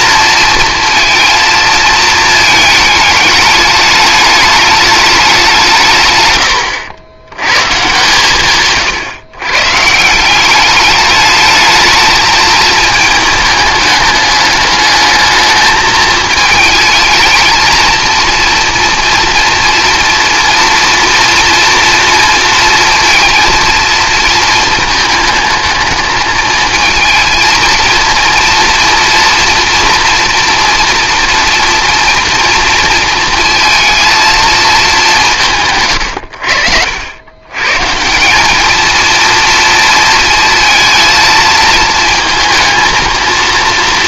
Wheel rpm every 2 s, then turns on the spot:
230, 220, 210, 100, 140, 200, 220, 210, 220, 230, 230, 230, 220, 220, 230, 240, 230, 220, 80, 220, 230, 230.
none